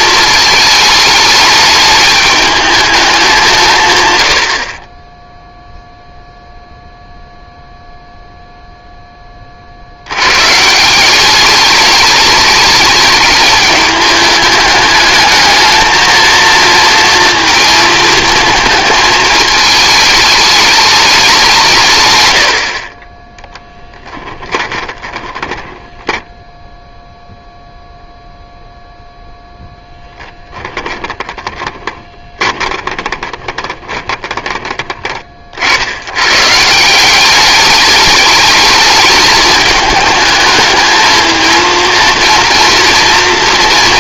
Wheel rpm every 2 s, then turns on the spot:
220, 210, 50, 0, 0, 150, 210, 210, 230, 220, 210, 60, 20, 0, 0, 10, 20, 20, 140, 210, 220, 230.
24-26 30-34